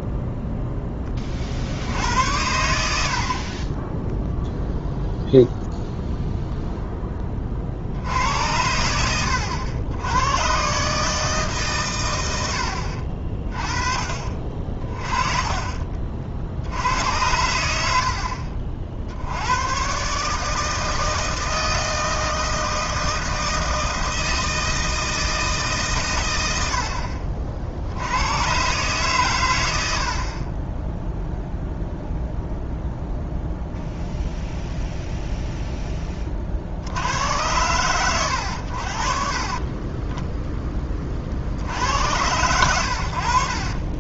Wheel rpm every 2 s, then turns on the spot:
10, 90, 0, 0, 90, 130, 80, 40, 80, 50, 160, 160, 160, 80, 120, 30, 0, 0, 70, 80, 20, 100.
12-14